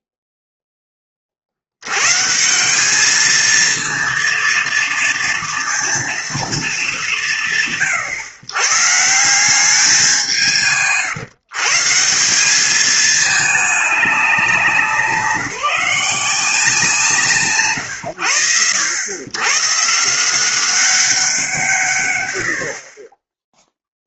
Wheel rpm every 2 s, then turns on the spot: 10, 170, 230, 210, 120, 160, 200, 190, 160, 90, 180, 100.
none